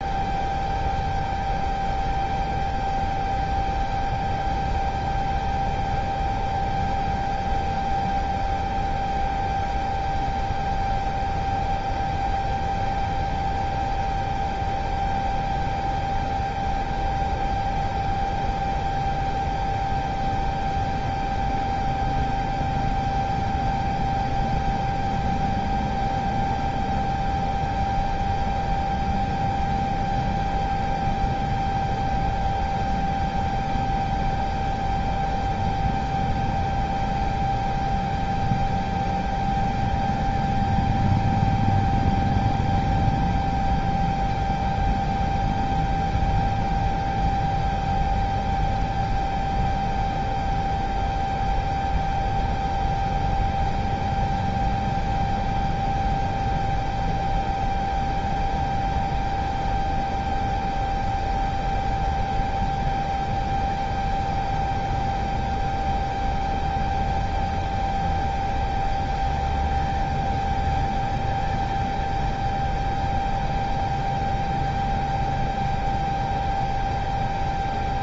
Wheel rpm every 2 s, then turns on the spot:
0, 0, 0, 0, 0, 0, 0, 0, 0, 0, 0, 0, 0, 0, 0, 0, 0, 0, 0, 0, 0, 0, 0, 0, 0, 0, 0, 0, 0, 0, 0, 0, 0, 0, 0, 0, 0, 0, 0.
none